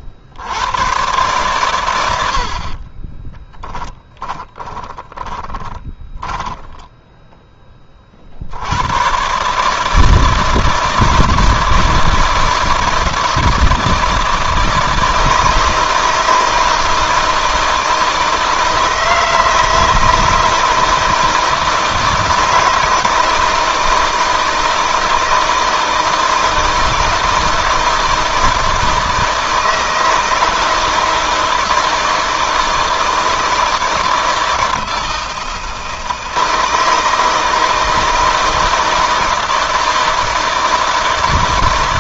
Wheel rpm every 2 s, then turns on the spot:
110, 30, 10, 20, 110, 160, 160, 160, 160, 160, 160, 160, 160, 170, 160, 160, 160, 160, 160, 160, 160.
2-8